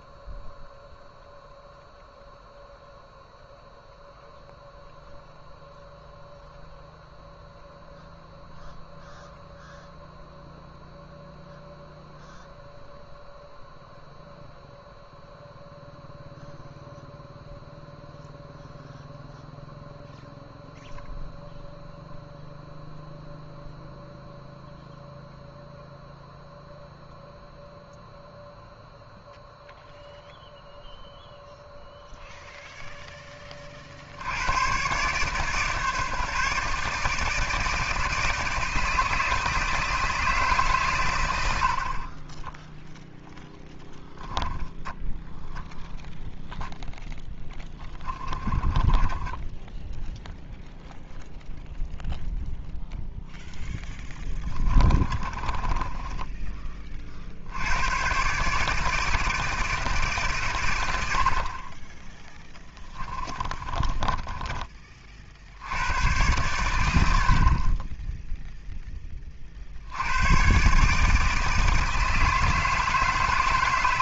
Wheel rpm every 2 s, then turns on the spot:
0, 0, 0, 0, 0, 0, 0, 0, 0, 0, 0, 0, 0, 0, 0, 0, 0, 120, 150, 160, 140, 0, 0, 0, 20, 0, 0, 20, 30, 160, 110, 20, 20, 100, 10, 140, 160.
48-50 54-56 62-64